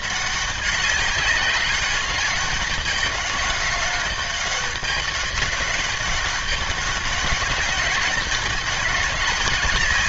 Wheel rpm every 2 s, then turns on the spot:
190, 200, 200, 200, 200.
none